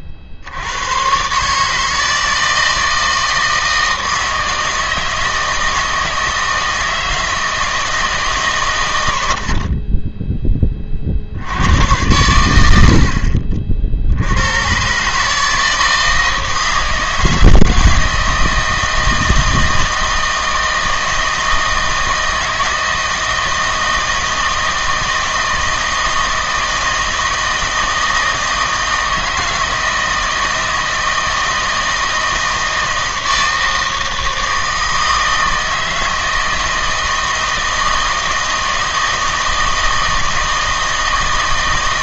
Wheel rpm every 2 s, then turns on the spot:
70, 160, 160, 160, 120, 20, 90, 100, 160, 160, 160, 160, 160, 160, 160, 160, 160, 160, 160, 160, 160.
none